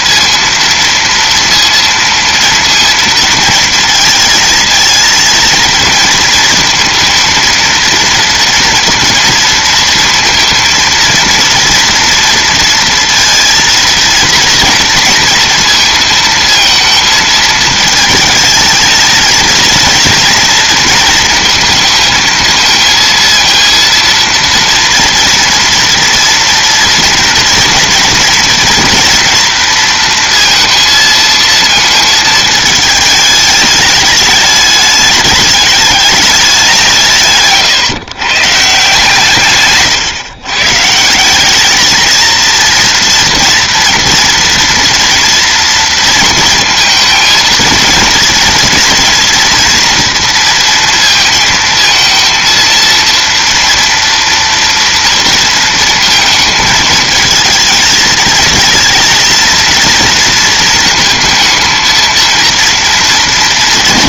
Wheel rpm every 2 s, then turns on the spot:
230, 230, 230, 230, 230, 230, 230, 230, 230, 220, 230, 230, 230, 230, 230, 230, 210, 210, 190, 140, 150, 230, 230, 220, 230, 230, 230, 230, 220, 230, 230, 220.
none